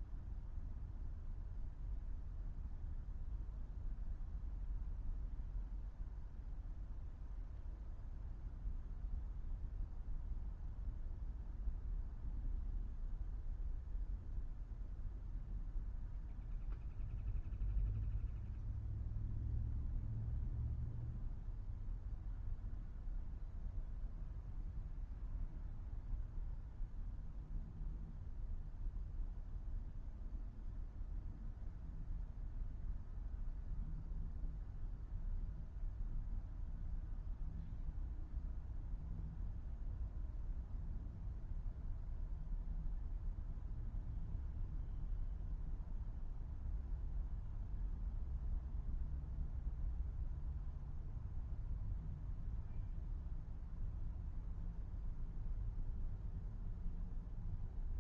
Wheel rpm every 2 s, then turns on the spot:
0, 0, 0, 0, 0, 0, 0, 0, 0, 0, 0, 0, 0, 0, 0, 0, 0, 0, 0, 0, 0, 0, 0, 0, 0, 0, 0, 0, 0.
none